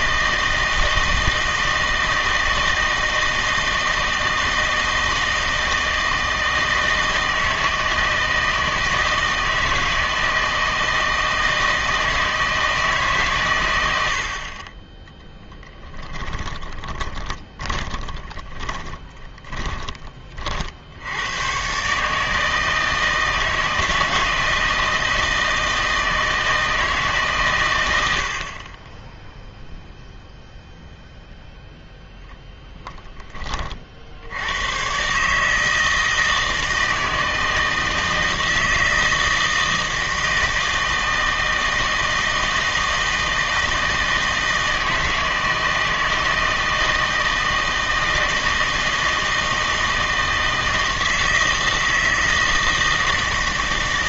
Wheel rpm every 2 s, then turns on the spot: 160, 160, 160, 160, 160, 160, 160, 20, 20, 20, 60, 160, 160, 160, 20, 0, 0, 110, 160, 160, 160, 160, 160, 160, 160, 160, 160.
16-20